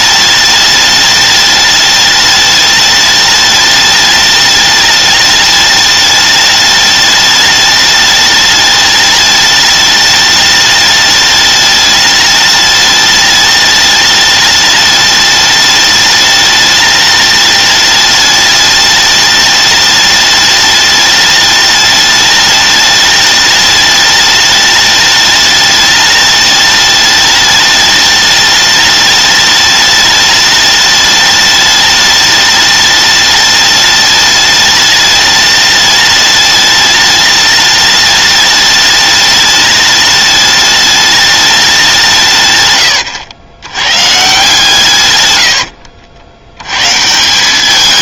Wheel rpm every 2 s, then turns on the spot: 210, 210, 210, 210, 210, 210, 210, 210, 210, 210, 210, 210, 210, 210, 210, 210, 210, 210, 210, 210, 210, 100, 120, 130.
none